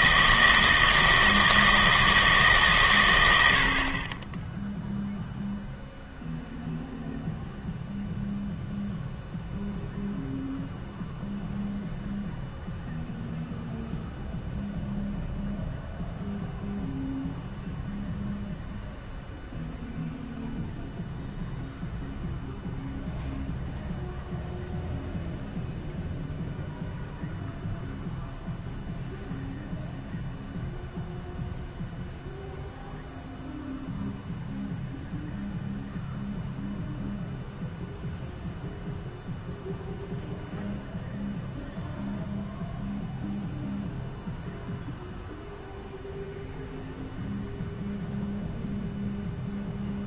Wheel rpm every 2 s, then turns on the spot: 160, 140, 0, 0, 0, 0, 0, 0, 0, 0, 0, 0, 0, 0, 0, 0, 0, 0, 0, 0, 0, 0, 0, 0, 0.
none